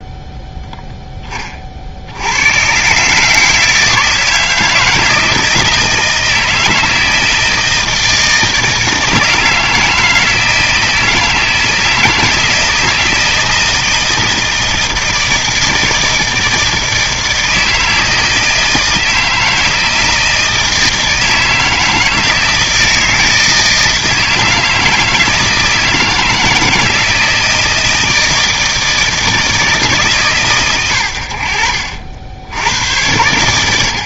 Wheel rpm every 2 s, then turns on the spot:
0, 130, 160, 160, 160, 160, 160, 160, 160, 160, 160, 160, 160, 160, 160, 110, 90.
none